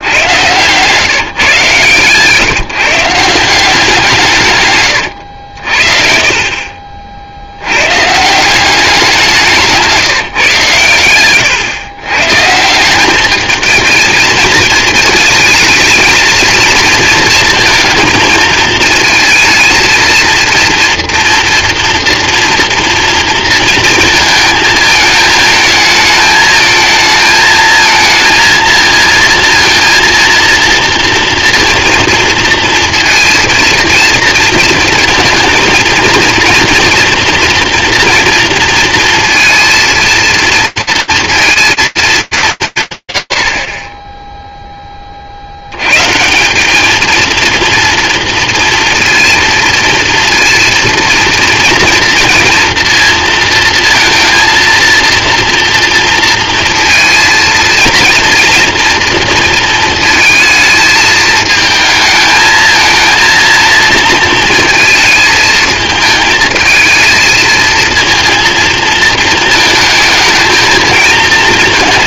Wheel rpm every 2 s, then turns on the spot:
130, 160, 120, 30, 190, 140, 170, 230, 230, 230, 230, 230, 220, 220, 230, 230, 230, 230, 240, 230, 230, 190, 0, 180, 230, 230, 240, 230, 230, 230, 220, 220, 230, 220, 230, 220.
none